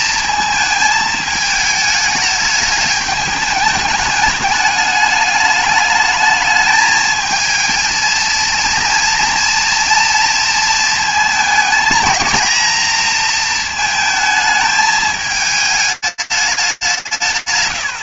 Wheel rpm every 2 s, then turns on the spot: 220, 210, 210, 220, 230, 230, 230, 220, 210.
none